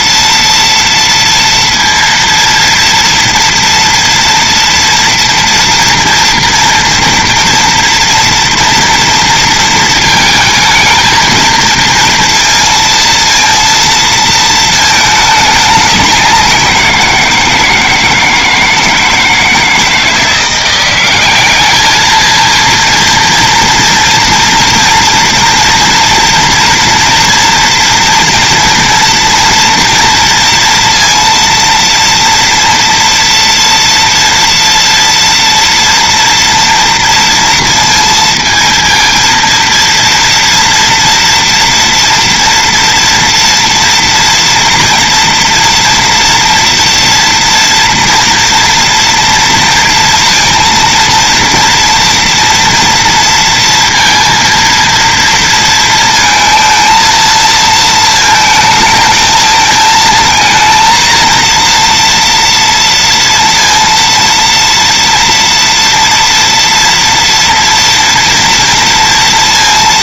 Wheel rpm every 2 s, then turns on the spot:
230, 230, 230, 230, 230, 220, 230, 220, 180, 160, 180, 230, 230, 230, 230, 230, 230, 230, 230, 230, 230, 230, 240, 230, 230, 230, 230, 230, 230, 220, 230, 230, 230, 230, 230.
none